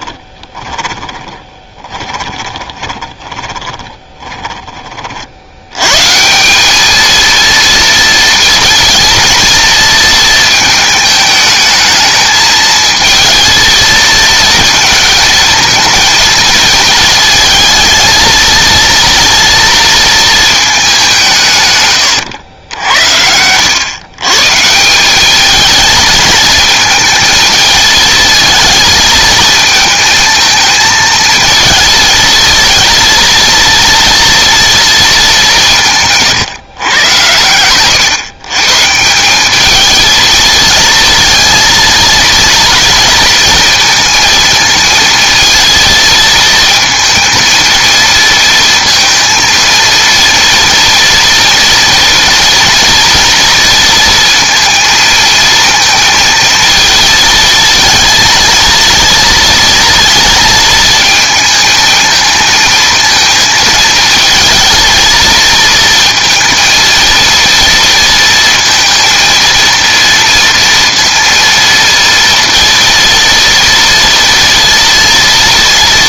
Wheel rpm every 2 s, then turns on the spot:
10, 20, 20, 200, 230, 220, 220, 230, 220, 230, 210, 80, 160, 220, 230, 220, 230, 230, 120, 130, 220, 230, 230, 230, 230, 230, 230, 230, 230, 230, 230, 220, 230, 230, 230, 230, 230, 230.
0-4